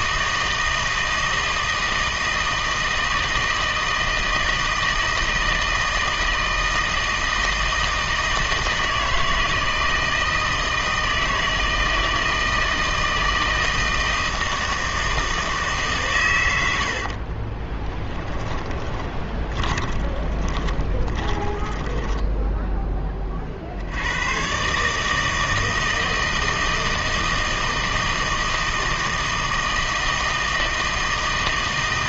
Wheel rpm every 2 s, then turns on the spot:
160, 160, 160, 160, 160, 160, 160, 160, 80, 20, 20, 10, 140, 160, 160, 160.
18-22